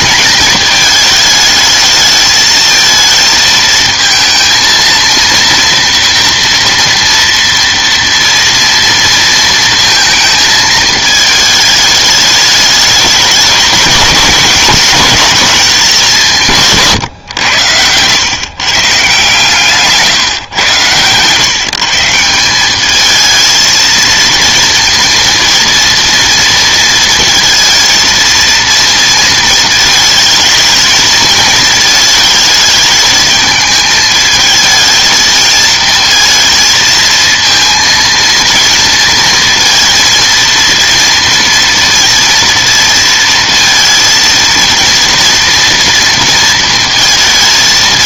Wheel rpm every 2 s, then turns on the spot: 220, 220, 230, 230, 230, 220, 210, 210, 150, 140, 130, 190, 230, 230, 230, 220, 220, 220, 230, 230, 230, 230, 230, 230.
none